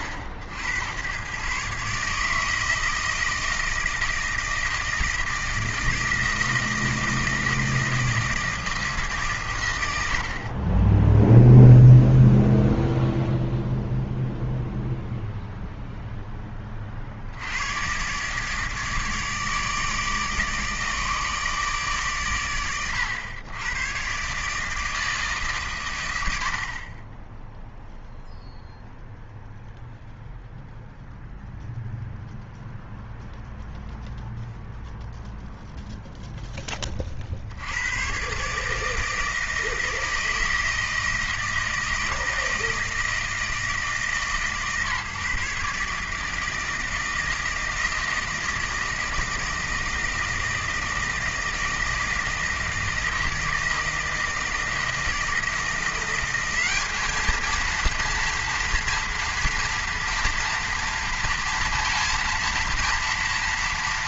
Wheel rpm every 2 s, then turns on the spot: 90, 160, 160, 160, 160, 40, 0, 0, 20, 150, 150, 110, 150, 50, 0, 0, 0, 0, 10, 140, 160, 160, 140, 160, 160, 160, 160, 160, 200, 230, 230, 230.
none